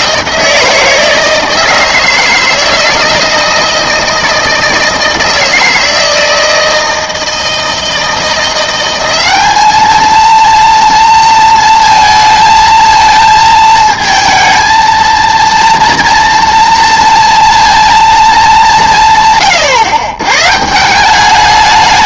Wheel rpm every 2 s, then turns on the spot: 160, 160, 160, 160, 180, 230, 220, 220, 230, 200, 150.
none